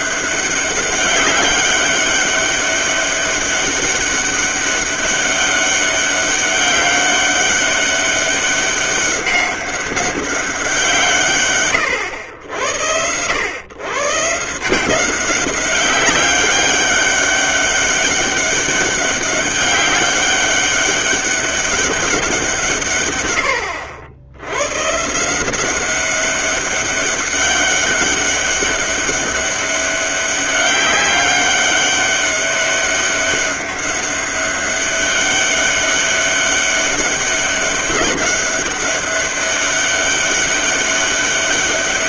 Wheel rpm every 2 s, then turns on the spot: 200, 200, 200, 200, 200, 170, 80, 180, 200, 200, 200, 150, 120, 200, 200, 200, 200, 200, 200, 200, 200.
none